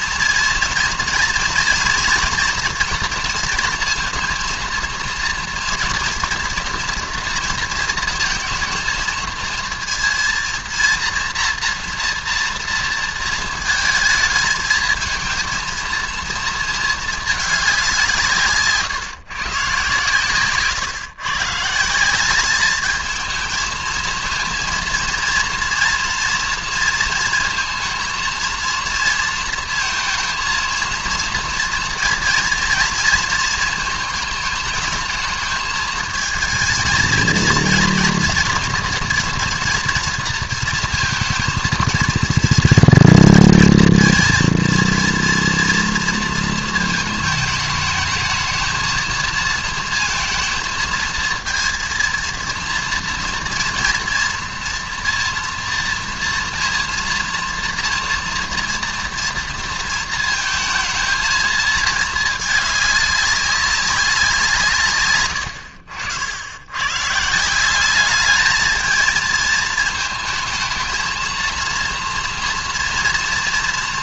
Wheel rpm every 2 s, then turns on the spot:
230, 230, 230, 230, 230, 230, 230, 220, 230, 150, 140, 210, 230, 230, 230, 230, 230, 220, 220, 240, 230, 230, 230, 230, 220, 230, 230, 230, 230, 230, 220, 210, 150, 100, 220, 220, 230.
20-22